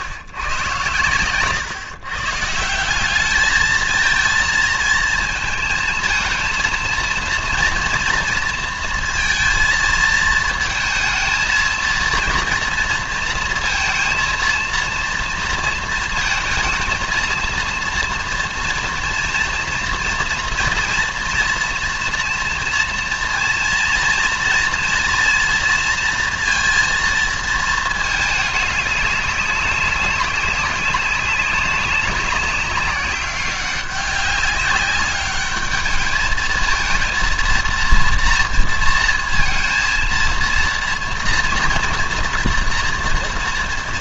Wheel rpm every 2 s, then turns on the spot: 110, 160, 230, 230, 230, 220, 230, 230, 230, 240, 230, 230, 230, 230, 200, 200, 190, 200, 220, 230, 230, 230.
none